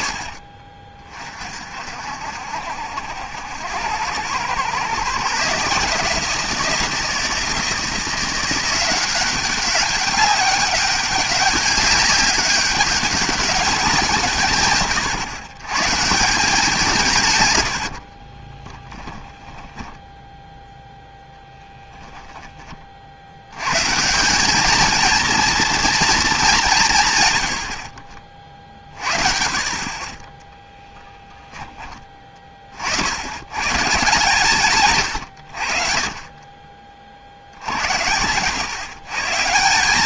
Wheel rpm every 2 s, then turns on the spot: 40, 80, 130, 170, 190, 200, 190, 110, 160, 10, 0, 50, 220, 150, 40, 10, 50, 150, 30, 120.
18-20